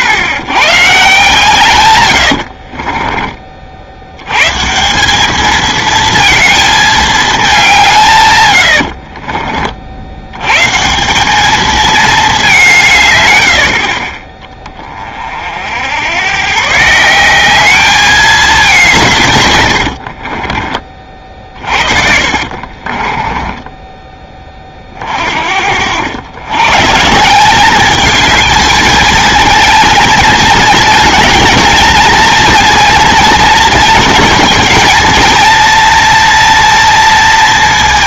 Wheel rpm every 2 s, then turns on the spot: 100, 50, 140, 230, 100, 140, 190, 20, 140, 190, 30, 50, 30, 130, 220, 230, 230, 220, 230.
2-4 8-10 20-24